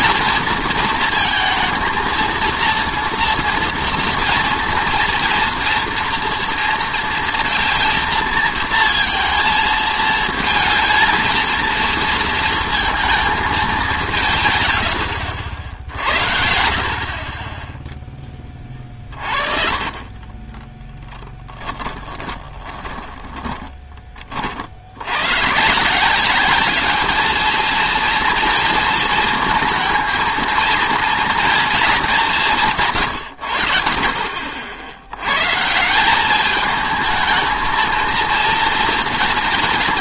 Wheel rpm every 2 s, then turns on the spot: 230, 230, 230, 230, 230, 230, 230, 120, 60, 30, 10, 20, 50, 200, 230, 230, 150, 50, 210, 230.
22-24